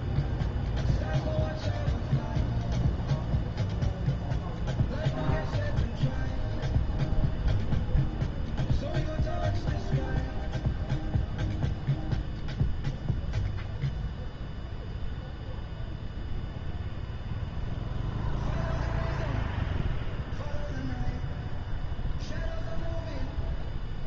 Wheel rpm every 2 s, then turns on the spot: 0, 0, 0, 0, 0, 0, 0, 0, 0, 0, 0, 0.
none